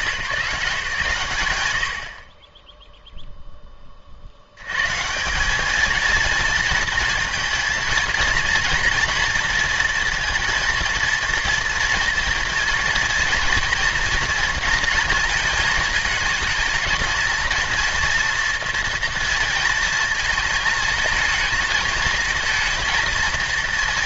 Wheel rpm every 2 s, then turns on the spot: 170, 10, 130, 230, 230, 230, 230, 230, 230, 230, 220, 230.
none